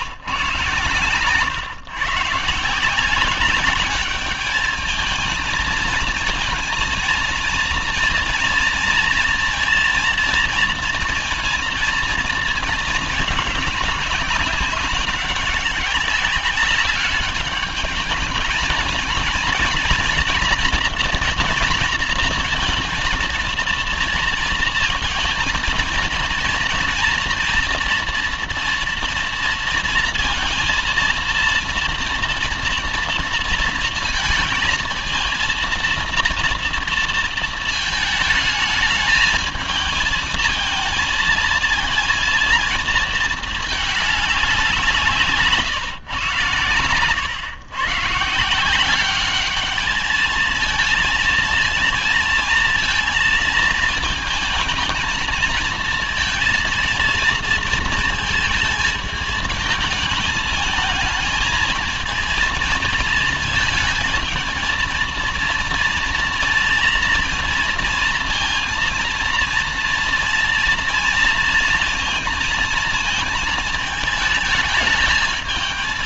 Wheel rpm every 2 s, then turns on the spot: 130, 150, 210, 230, 240, 230, 220, 200, 200, 210, 240, 230, 230, 230, 230, 230, 230, 230, 230, 220, 220, 230, 190, 130, 160, 220, 230, 220, 230, 220, 220, 230, 220, 230, 230, 230, 230, 220.
none